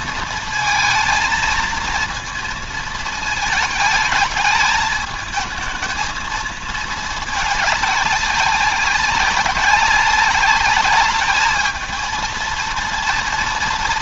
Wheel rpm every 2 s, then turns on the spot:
220, 220, 220, 220, 200, 200, 230.
none